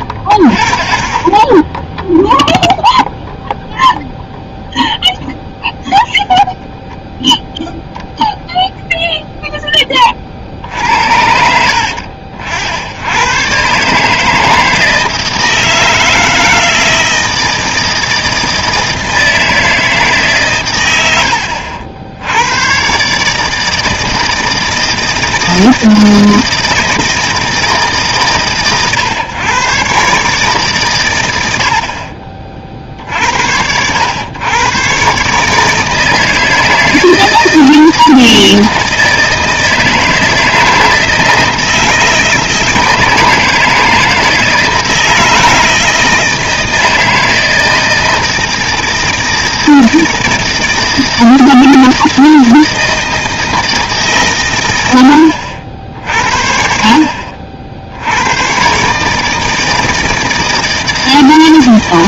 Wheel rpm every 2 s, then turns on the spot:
30, 0, 0, 0, 0, 60, 80, 160, 160, 160, 120, 100, 160, 160, 130, 140, 50, 110, 160, 160, 160, 160, 160, 160, 160, 160, 160, 110, 60, 120, 160.
none